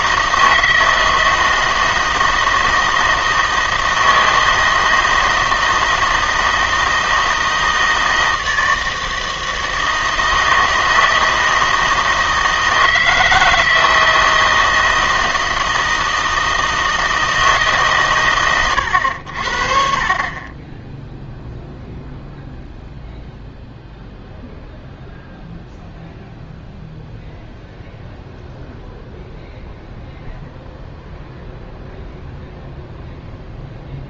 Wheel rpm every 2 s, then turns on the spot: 160, 160, 160, 160, 160, 160, 160, 160, 160, 100, 10, 0, 0, 0, 0, 0, 0.
none